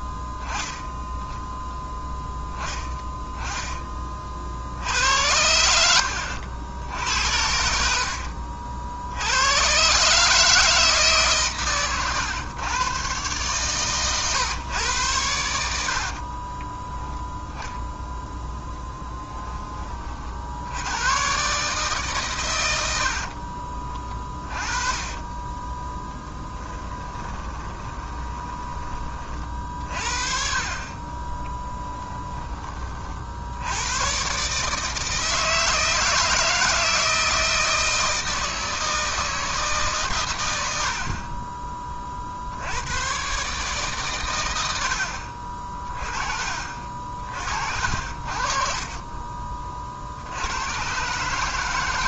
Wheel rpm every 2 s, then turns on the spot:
10, 10, 70, 80, 60, 150, 120, 110, 10, 10, 90, 80, 30, 20, 20, 40, 40, 150, 160, 160, 60, 100, 80, 50, 40, 120.
16-18 24-28 30-32